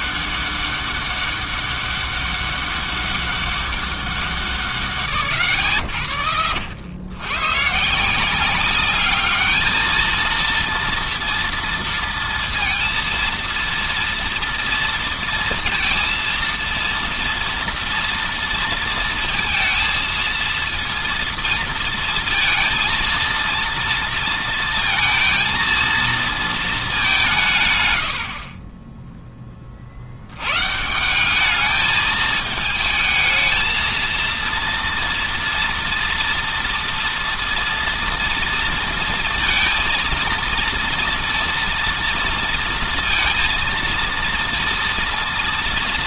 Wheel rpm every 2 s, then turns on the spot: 200, 200, 170, 50, 180, 220, 230, 230, 230, 230, 230, 230, 230, 230, 70, 90, 220, 230, 230, 230, 230, 230, 230.
none